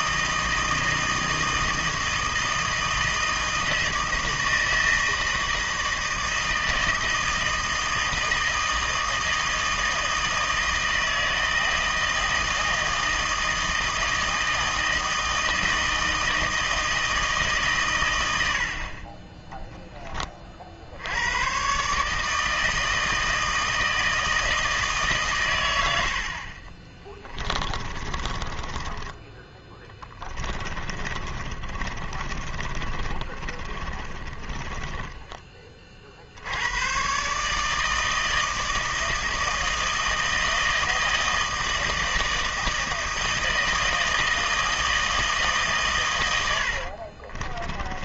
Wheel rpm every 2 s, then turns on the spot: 160, 160, 160, 160, 160, 160, 160, 160, 160, 60, 60, 160, 160, 30, 30, 30, 40, 20, 100, 160, 160, 160, 160, 80.
26-36 46-48